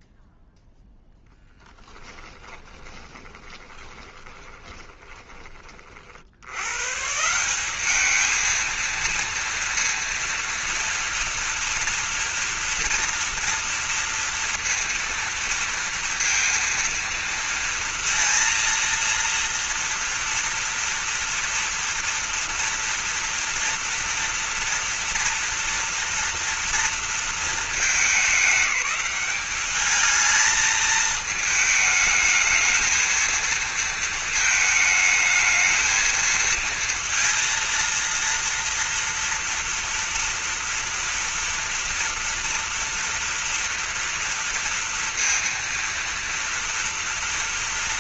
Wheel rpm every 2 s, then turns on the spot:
0, 30, 20, 110, 230, 230, 230, 230, 230, 230, 230, 230, 230, 230, 200, 220, 220, 220, 230, 230, 230, 230, 230, 230.
2-6